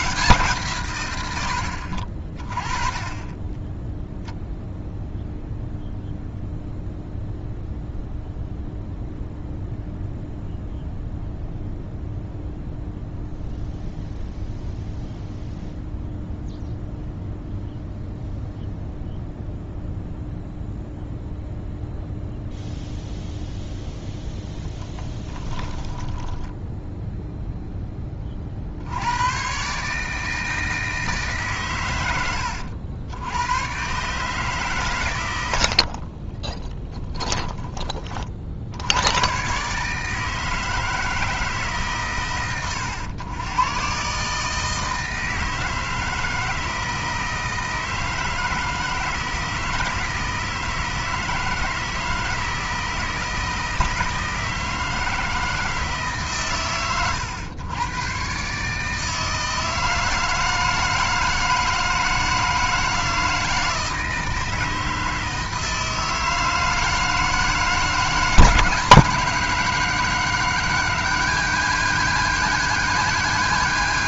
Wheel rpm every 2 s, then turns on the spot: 150, 30, 0, 0, 0, 0, 0, 0, 0, 0, 0, 0, 0, 10, 40, 160, 80, 140, 10, 60, 160, 120, 150, 160, 160, 160, 160, 160, 130, 140, 160, 160, 160, 160, 150, 160, 170.
26-28 36-38